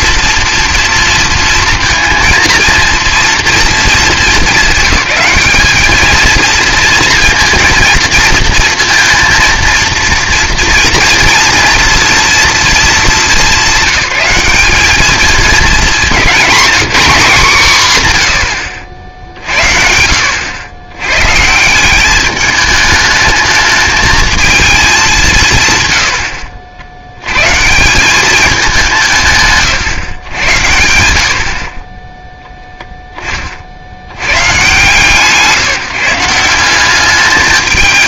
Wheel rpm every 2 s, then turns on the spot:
230, 220, 200, 230, 230, 230, 230, 200, 220, 90, 80, 210, 220, 70, 200, 100, 0, 130, 180.
none